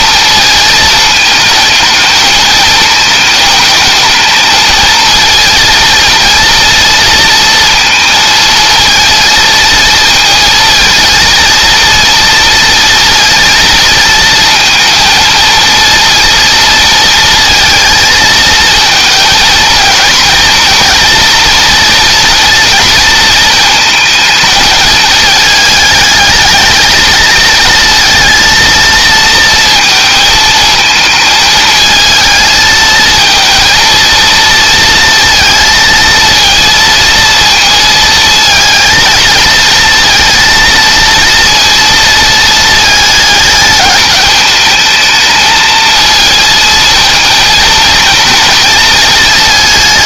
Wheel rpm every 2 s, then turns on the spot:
220, 220, 230, 230, 220, 230, 230, 230, 230, 220, 230, 230, 220, 220, 230, 220, 220, 230, 230, 230, 230, 220, 220, 230, 230.
none